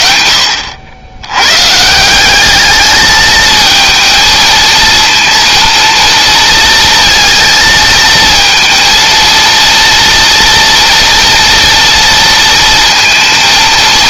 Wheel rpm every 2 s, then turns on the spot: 90, 210, 230, 230, 230, 240, 230.
none